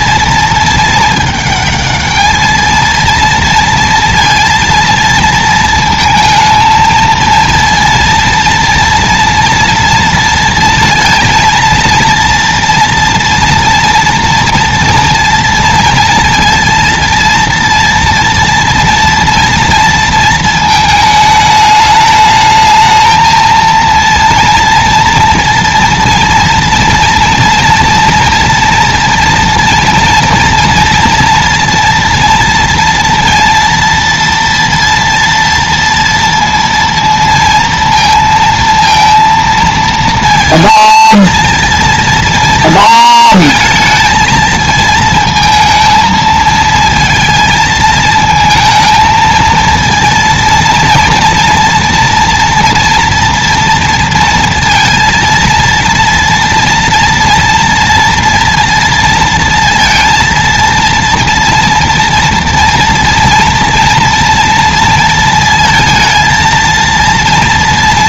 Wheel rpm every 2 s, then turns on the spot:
220, 220, 230, 220, 230, 230, 230, 230, 230, 230, 220, 220, 230, 230, 230, 230, 230, 230, 230, 230, 230, 220, 220, 220, 230, 230, 230, 230, 230, 230, 230, 240, 230, 230.
none